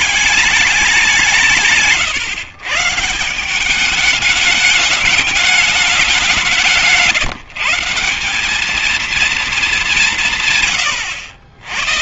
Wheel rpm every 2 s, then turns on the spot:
150, 210, 170, 210, 130, 60.
none